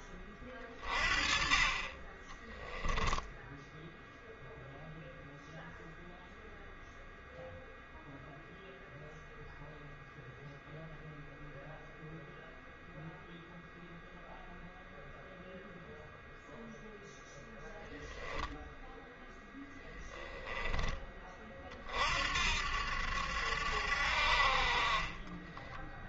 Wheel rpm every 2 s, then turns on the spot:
30, 10, 0, 0, 0, 0, 0, 0, 0, 0, 20, 70, 40.
none